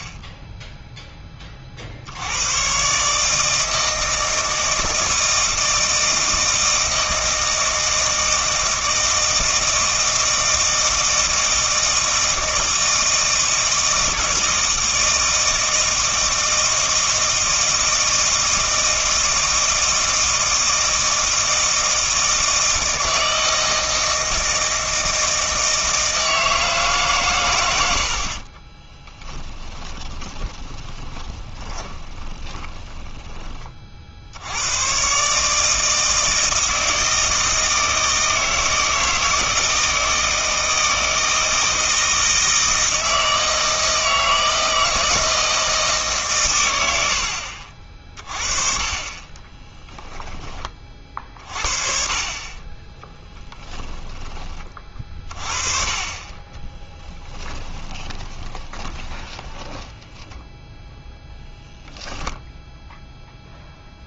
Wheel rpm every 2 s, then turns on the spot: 0, 120, 160, 160, 160, 160, 160, 160, 160, 160, 160, 160, 160, 150, 30, 20, 20, 100, 160, 160, 160, 160, 160, 100, 30, 30, 20, 30, 20, 20, 10, 0.
28-34 56-60